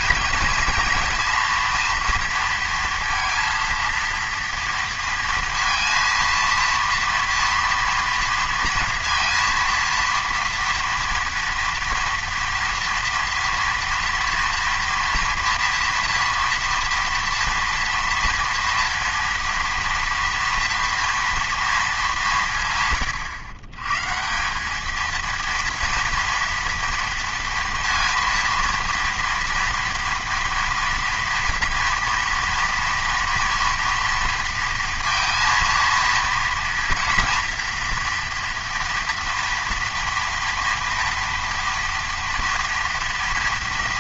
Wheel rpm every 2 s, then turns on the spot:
230, 230, 230, 230, 230, 230, 230, 230, 230, 230, 230, 140, 210, 240, 230, 230, 230, 230, 230, 230, 230, 230.
none